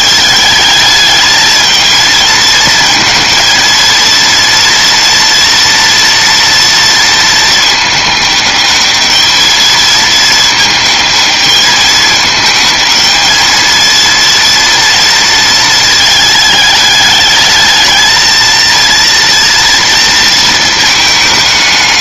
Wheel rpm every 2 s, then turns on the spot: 220, 220, 230, 230, 210, 220, 220, 230, 210, 220, 220.
none